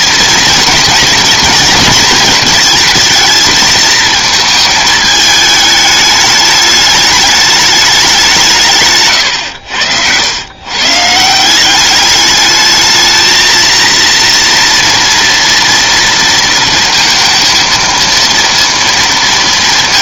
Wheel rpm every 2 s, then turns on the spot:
230, 220, 220, 210, 140, 140, 220, 230, 230, 230.
none